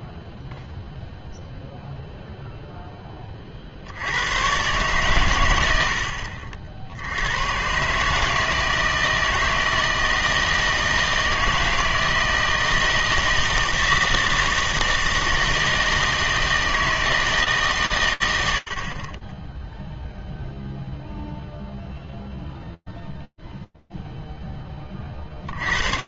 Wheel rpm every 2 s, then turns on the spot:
0, 0, 130, 80, 160, 160, 160, 160, 160, 70, 0, 0, 70.
none